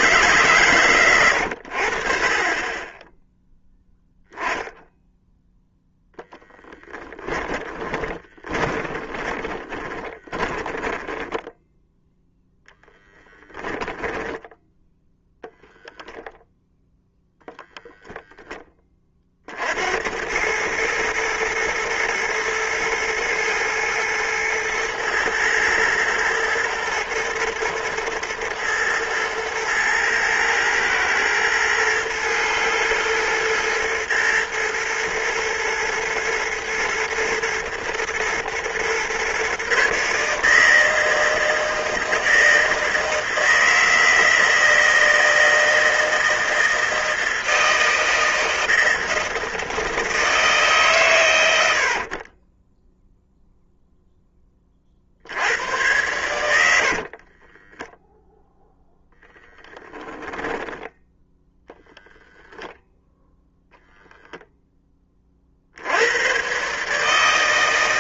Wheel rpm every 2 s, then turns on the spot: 140, 30, 10, 10, 20, 20, 0, 0, 0, 10, 100, 120, 110, 120, 110, 110, 120, 120, 110, 120, 150, 160, 160, 160, 160, 150, 20, 30, 100, 0, 10, 0, 0, 120.
6-12